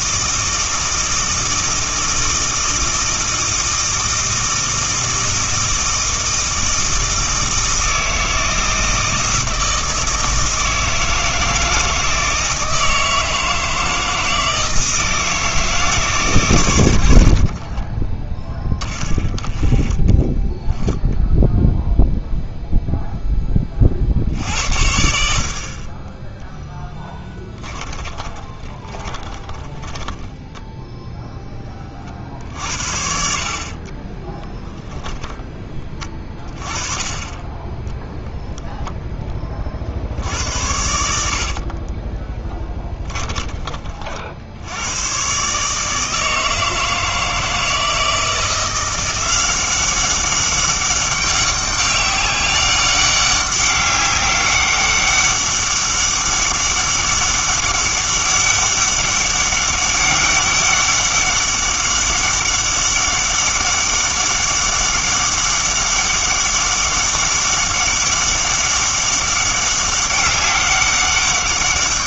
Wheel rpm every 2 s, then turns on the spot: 160, 160, 160, 160, 160, 160, 160, 160, 110, 20, 10, 0, 70, 10, 30, 10, 60, 10, 20, 0, 90, 10, 90, 160, 170, 190, 200, 200, 200, 200, 200, 200, 200, 200, 200, 190.
28-32 42-44